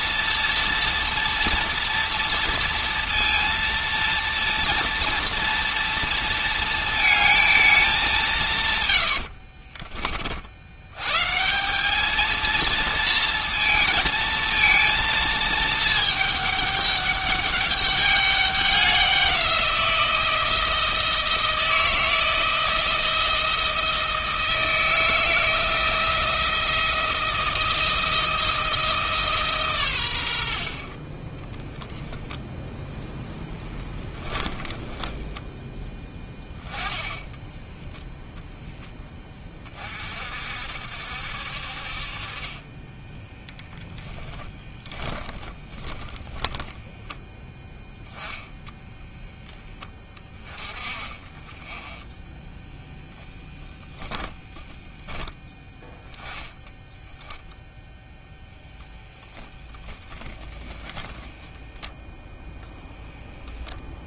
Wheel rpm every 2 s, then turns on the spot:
230, 230, 230, 230, 100, 100, 230, 230, 200, 190, 160, 160, 160, 160, 160, 20, 10, 10, 10, 10, 60, 20, 10, 10, 10, 30, 10, 10, 0, 0, 10, 0.
8-10 32-36 44-46 48-50 52-54